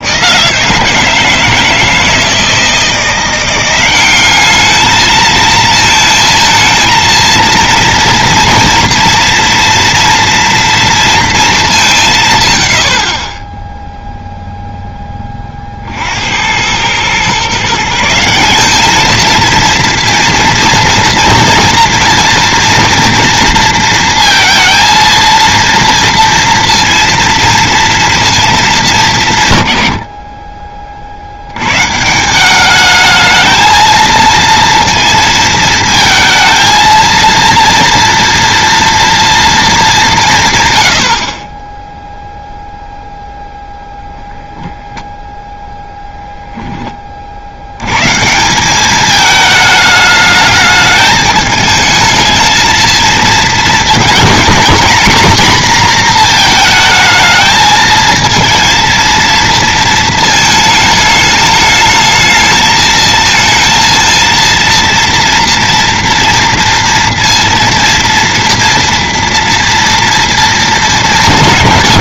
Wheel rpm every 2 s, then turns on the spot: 160, 160, 210, 220, 230, 230, 110, 0, 90, 190, 230, 240, 230, 230, 220, 30, 190, 230, 220, 230, 150, 0, 0, 10, 190, 210, 230, 230, 230, 230, 220, 220, 230, 230, 240, 230.
none